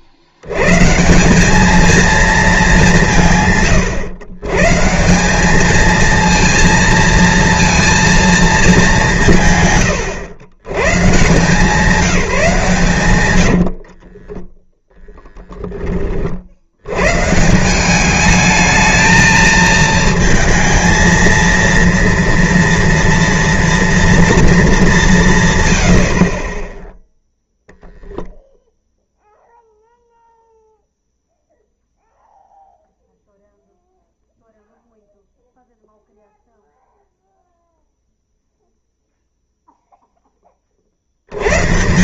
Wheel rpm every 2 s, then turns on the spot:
110, 210, 130, 220, 210, 120, 160, 10, 60, 220, 230, 230, 220, 20, 0, 0, 0, 0, 0, 0, 30.
none